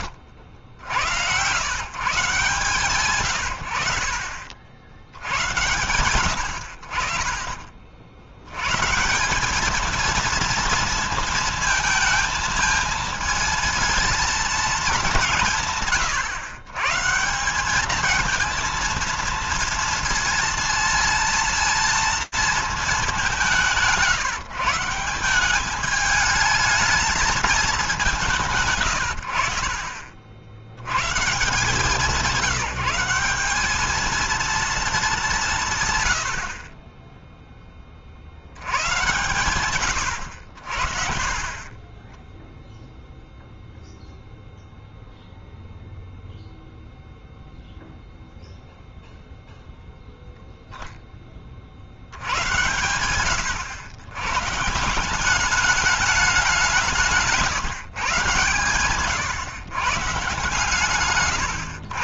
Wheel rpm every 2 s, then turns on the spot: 70, 150, 60, 60, 100, 230, 220, 220, 120, 220, 230, 220, 150, 220, 140, 80, 180, 220, 50, 80, 60, 0, 0, 0, 0, 0, 90, 140, 190, 130, 130.
60-62